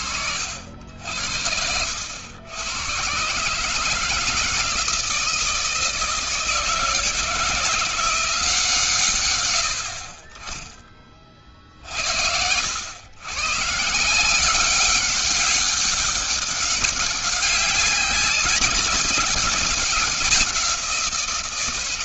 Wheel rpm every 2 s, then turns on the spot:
60, 110, 160, 160, 150, 20, 90, 180, 200, 200, 180.
none